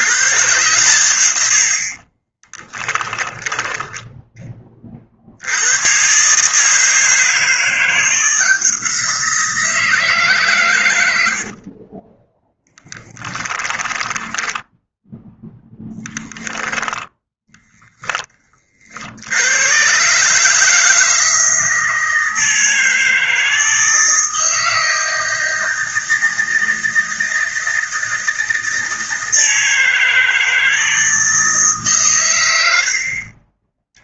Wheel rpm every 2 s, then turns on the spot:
110, 10, 40, 160, 170, 100, 10, 10, 0, 60, 160, 160, 160, 160, 160, 160, 60.
2-4 12-14